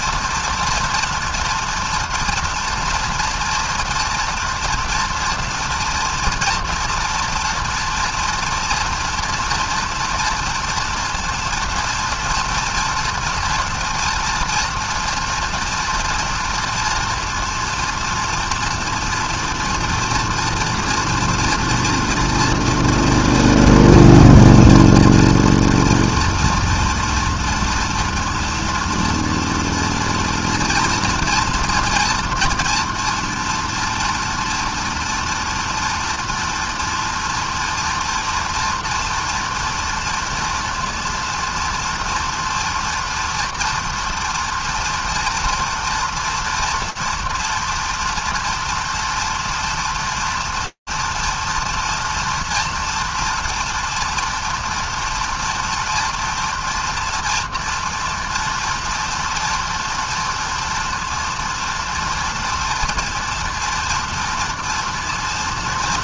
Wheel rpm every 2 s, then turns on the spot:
230, 230, 240, 230, 230, 230, 230, 230, 240, 230, 230, 240, 230, 230, 230, 230, 240, 240, 230, 240, 230, 230, 230, 230, 230, 230, 230, 240, 230, 230, 230, 230, 230.
none